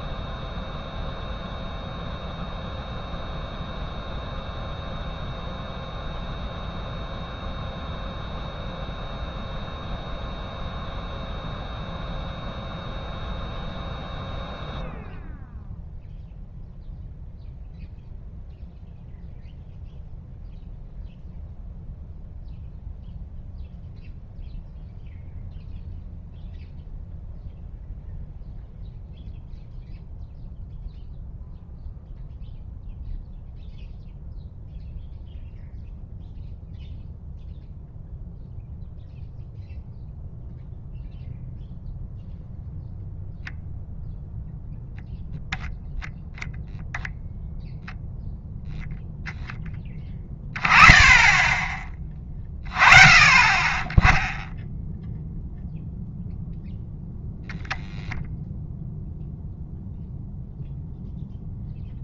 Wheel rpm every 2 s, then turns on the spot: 0, 0, 0, 0, 0, 0, 0, 0, 0, 0, 0, 0, 0, 0, 0, 0, 0, 0, 0, 0, 0, 0, 0, 0, 0, 10, 30, 0, 0, 0, 0.
none